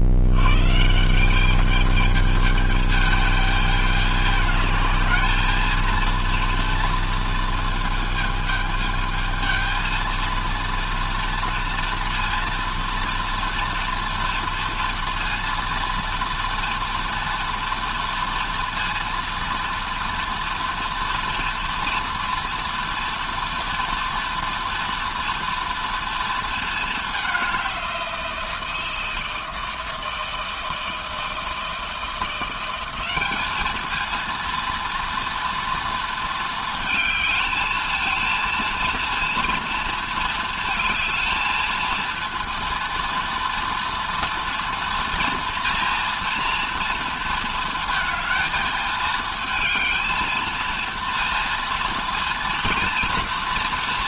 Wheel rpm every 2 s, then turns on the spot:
110, 220, 210, 230, 220, 220, 230, 230, 230, 230, 230, 230, 230, 230, 170, 160, 180, 230, 230, 230, 230, 230, 230, 230, 220, 230, 230.
none